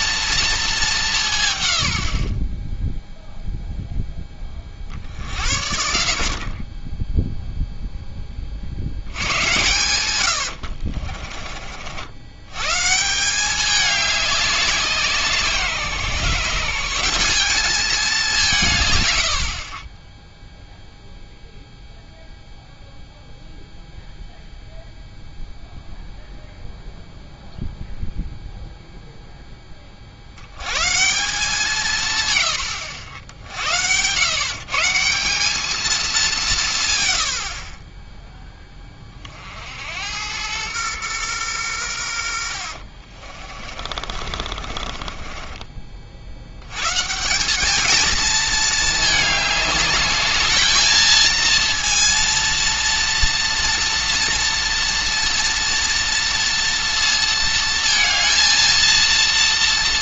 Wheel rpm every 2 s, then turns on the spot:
220, 10, 40, 40, 70, 60, 140, 190, 170, 140, 0, 0, 0, 0, 0, 120, 90, 150, 130, 20, 110, 50, 40, 120, 220, 220, 230, 230, 230, 230.
10-12 42-46